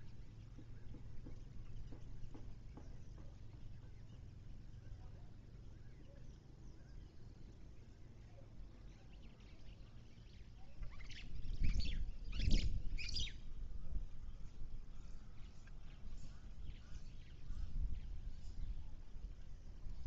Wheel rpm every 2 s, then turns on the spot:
0, 0, 0, 0, 0, 0, 0, 0, 0, 0.
none